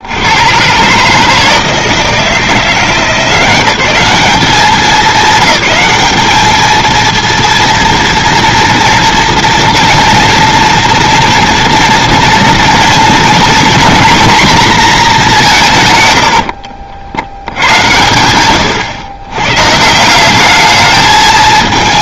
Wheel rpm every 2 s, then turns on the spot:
120, 170, 210, 220, 230, 230, 230, 230, 60, 110, 210.
none